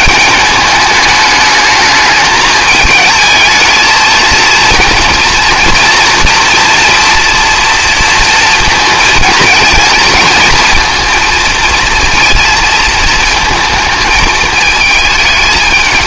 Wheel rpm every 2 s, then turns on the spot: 210, 220, 230, 240, 230, 220, 220, 220.
none